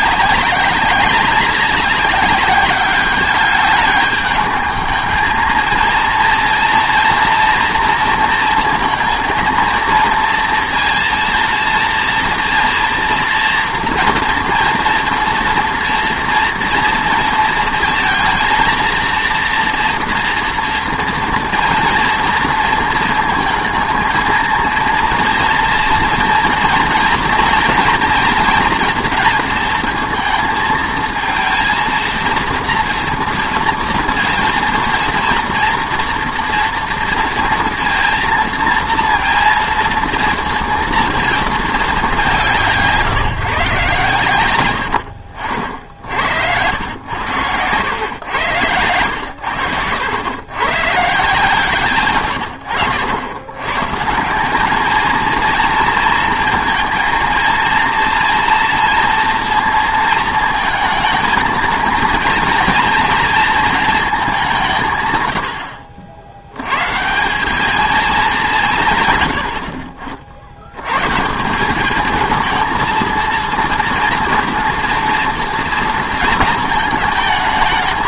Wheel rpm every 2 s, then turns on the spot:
190, 200, 220, 230, 230, 230, 240, 230, 230, 230, 230, 230, 230, 230, 230, 220, 230, 230, 240, 230, 230, 180, 90, 90, 110, 120, 90, 210, 230, 230, 220, 230, 170, 110, 160, 90, 230, 230, 220.
52-54